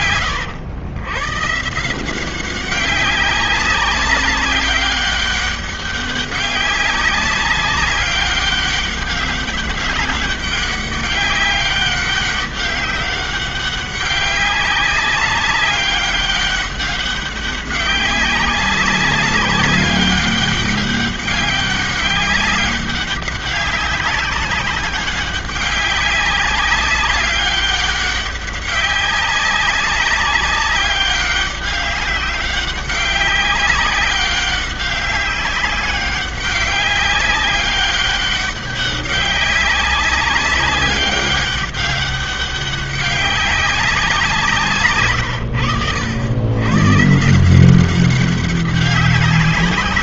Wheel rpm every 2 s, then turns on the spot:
90, 190, 190, 200, 200, 200, 200, 200, 200, 190, 200, 200, 200, 200, 200, 200, 190, 190, 200, 200, 200, 200, 160, 100, 200.
none